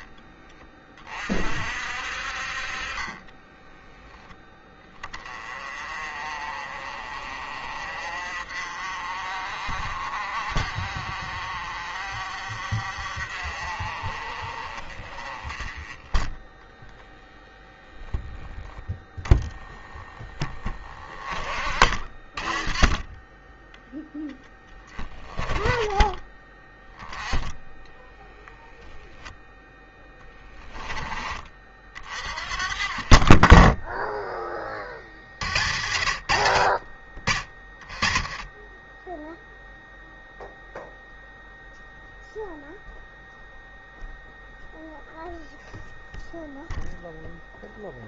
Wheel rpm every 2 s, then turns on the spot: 30, 50, 10, 40, 40, 40, 50, 40, 10, 10, 20, 20, 10, 30, 0, 10, 40, 20, 90, 30, 0, 0, 0, 0.
2-4